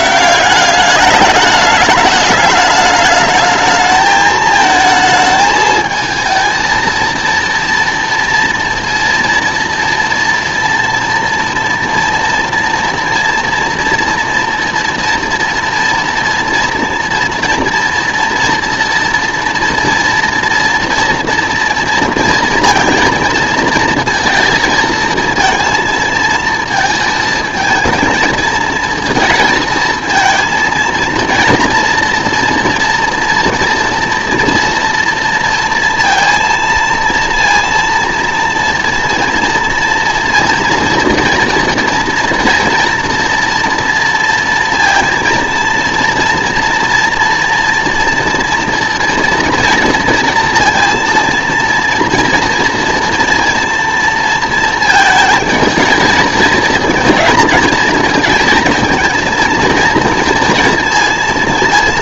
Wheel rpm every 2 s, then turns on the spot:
200, 210, 220, 230, 230, 240, 230, 230, 230, 230, 230, 230, 220, 220, 220, 230, 230, 240, 230, 230, 230, 230, 230, 230, 240, 230, 230, 230, 220, 220, 230.
none